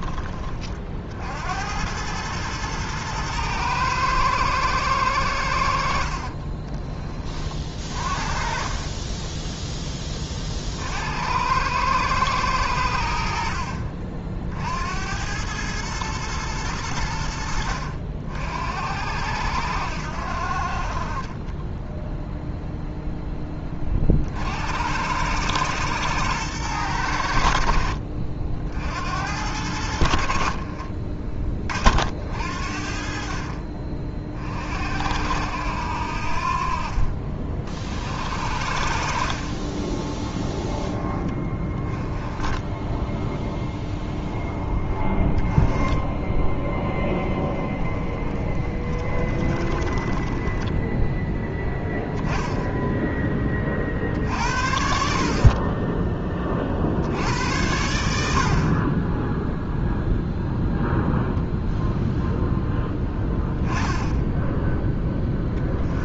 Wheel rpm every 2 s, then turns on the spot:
40, 110, 110, 30, 40, 70, 80, 70, 100, 70, 40, 0, 80, 100, 60, 40, 60, 50, 50, 50, 10, 10, 20, 10, 20, 10, 10, 60, 50, 30, 0, 10, 10.
6-10 42-44 48-50